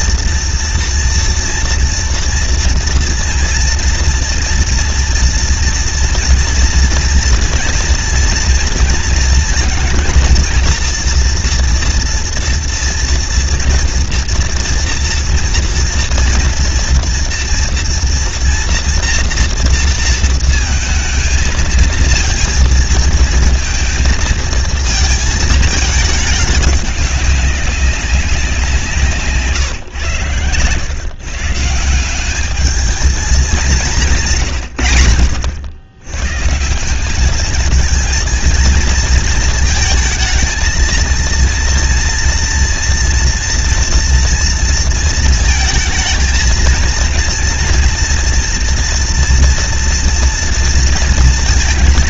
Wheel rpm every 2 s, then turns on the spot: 230, 230, 230, 230, 230, 230, 230, 230, 230, 230, 230, 230, 230, 200, 190, 120, 210, 150, 130, 230, 230, 230, 230, 220, 240, 230.
30-32